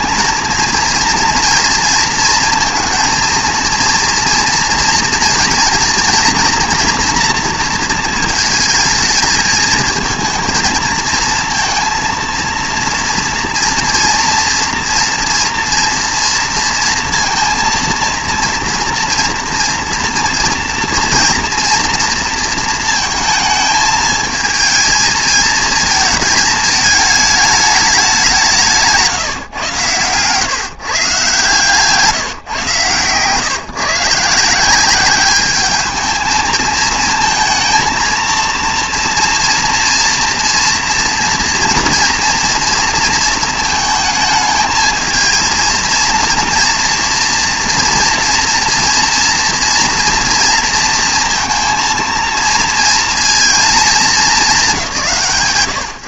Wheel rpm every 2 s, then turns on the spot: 230, 230, 230, 230, 230, 230, 230, 230, 230, 240, 230, 230, 220, 220, 170, 140, 130, 170, 220, 230, 230, 230, 220, 230, 230, 230, 230, 170.
none